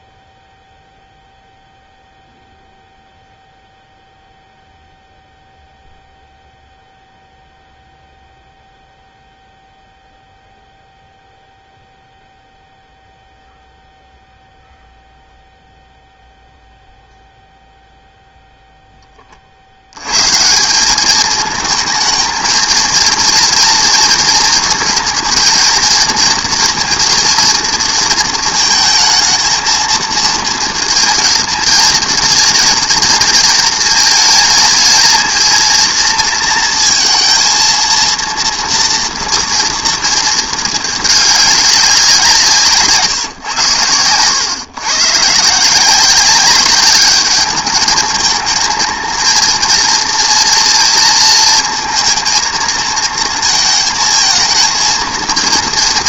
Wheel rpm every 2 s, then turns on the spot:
0, 0, 0, 0, 0, 0, 0, 0, 0, 0, 170, 220, 230, 230, 220, 230, 230, 220, 230, 230, 220, 160, 120, 200, 220, 230, 230, 220.
none